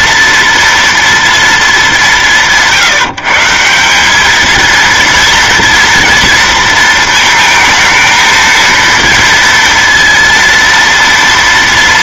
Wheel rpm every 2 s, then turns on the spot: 230, 160, 220, 230, 230, 230.
none